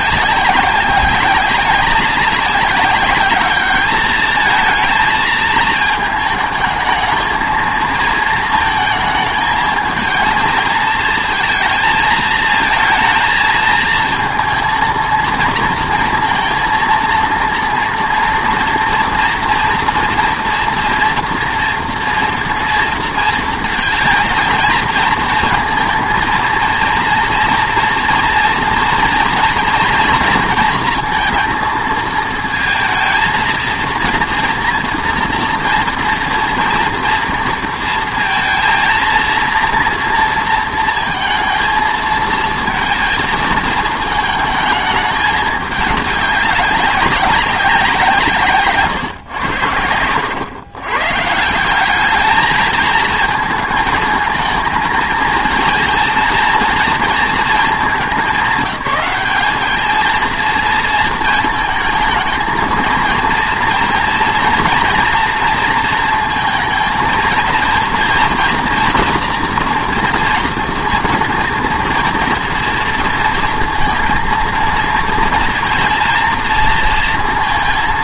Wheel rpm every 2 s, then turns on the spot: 190, 200, 220, 220, 230, 230, 220, 230, 230, 230, 240, 230, 230, 230, 240, 230, 230, 230, 230, 230, 230, 230, 220, 200, 140, 120, 220, 220, 230, 190, 230, 220, 240, 230, 230, 230, 230, 230, 230.
none